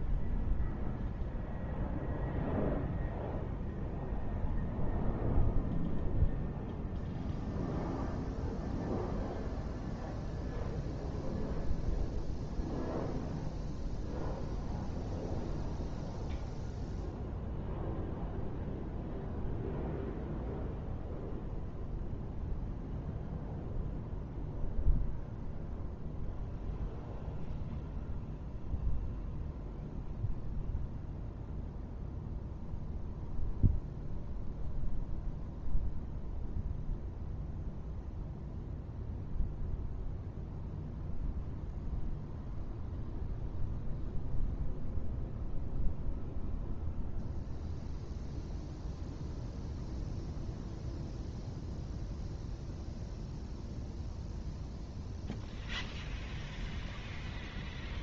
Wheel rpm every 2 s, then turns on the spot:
0, 0, 0, 0, 0, 0, 0, 0, 0, 0, 0, 0, 0, 0, 0, 0, 0, 0, 0, 0, 0, 0, 0, 0, 0, 0, 0, 0, 0.
none